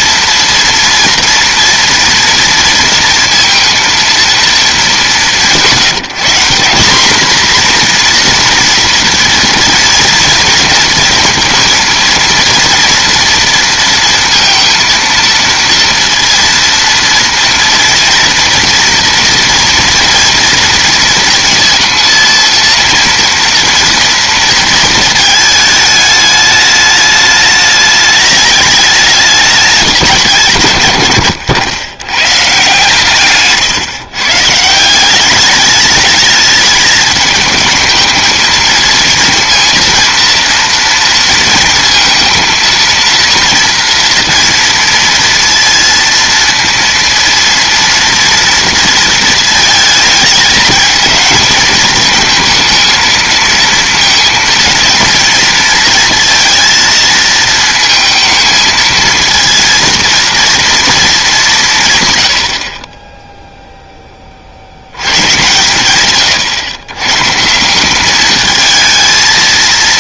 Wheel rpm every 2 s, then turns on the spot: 230, 230, 210, 180, 240, 230, 230, 230, 230, 230, 230, 230, 230, 210, 210, 140, 140, 150, 210, 220, 230, 230, 230, 230, 230, 220, 230, 230, 230, 220, 230, 60, 80, 120, 220.
none